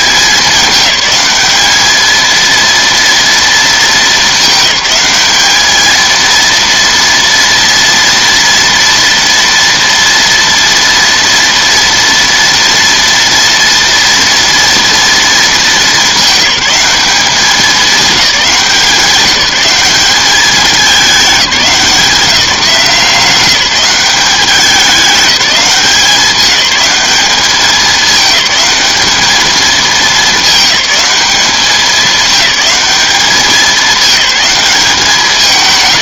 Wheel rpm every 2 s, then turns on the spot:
210, 230, 210, 230, 230, 240, 230, 230, 200, 190, 200, 160, 190, 210, 210, 210, 210, 200.
none